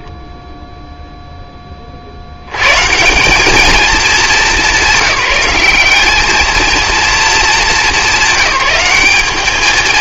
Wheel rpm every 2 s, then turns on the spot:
0, 120, 190, 220, 210.
none